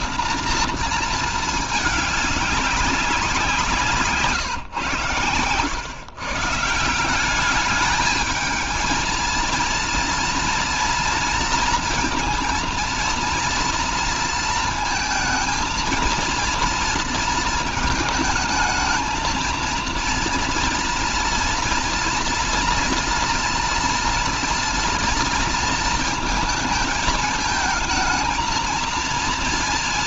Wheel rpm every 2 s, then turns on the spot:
230, 190, 150, 170, 220, 230, 230, 230, 230, 220, 230, 230, 230, 220, 220.
none